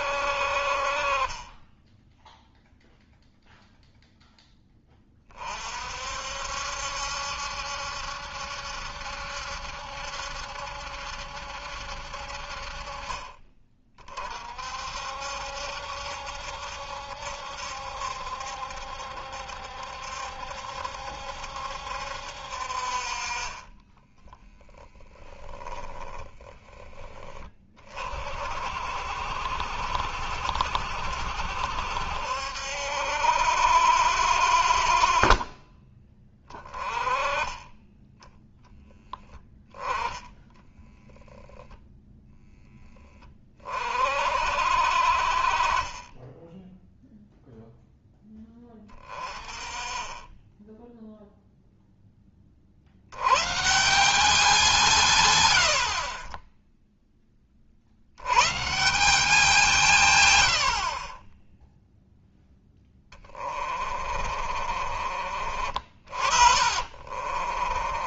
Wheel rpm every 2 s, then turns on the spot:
50, 0, 10, 70, 70, 70, 50, 50, 70, 70, 70, 60, 10, 20, 60, 60, 70, 50, 20, 10, 10, 20, 50, 10, 10, 10, 40, 180, 10, 140, 80, 10, 40, 50.
40-42 64-68